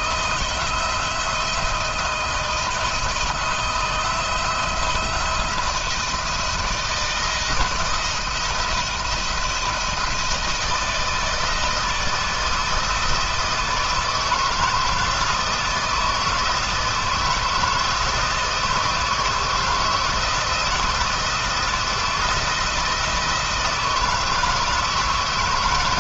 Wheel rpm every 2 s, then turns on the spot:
170, 160, 170, 170, 160, 160, 160, 160, 160, 160, 170, 160, 160.
none